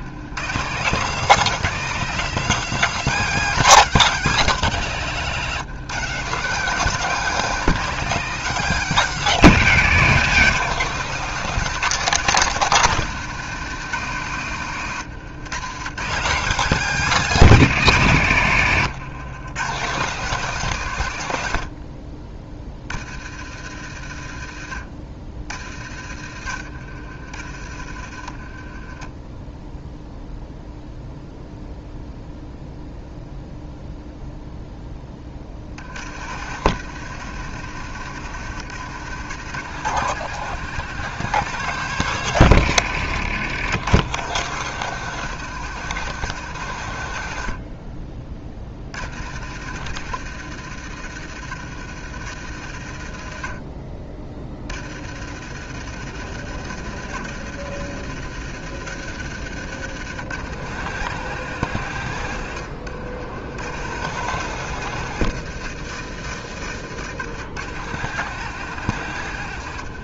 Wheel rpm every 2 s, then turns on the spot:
170, 200, 170, 170, 180, 180, 170, 130, 180, 120, 140, 40, 50, 60, 20, 0, 0, 10, 90, 100, 130, 90, 120, 90, 60, 80, 60, 60, 80, 90, 120, 70, 120, 80, 110.
66-68